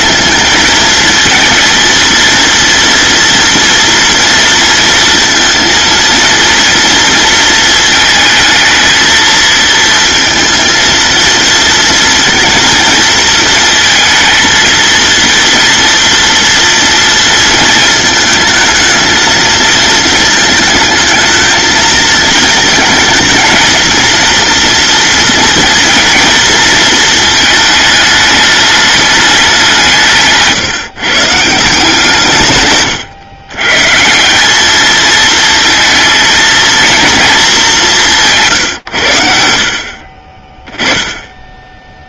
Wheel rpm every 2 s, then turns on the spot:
230, 230, 230, 230, 220, 230, 220, 230, 220, 220, 220, 220, 230, 220, 190, 160, 100, 220, 220, 70, 10.
none